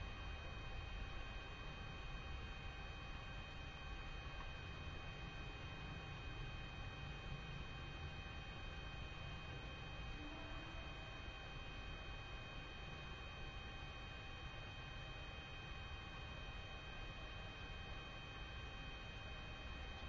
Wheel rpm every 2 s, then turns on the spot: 0, 0, 0, 0, 0, 0, 0, 0, 0, 0.
none